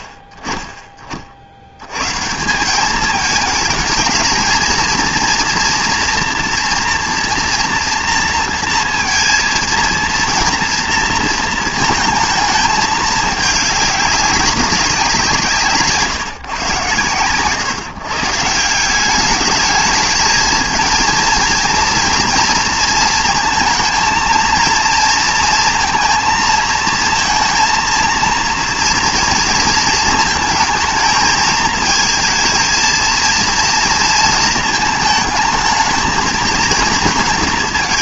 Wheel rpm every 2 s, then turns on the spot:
30, 190, 220, 230, 230, 230, 220, 190, 130, 160, 220, 230, 230, 220, 230, 220, 230, 220, 220.
none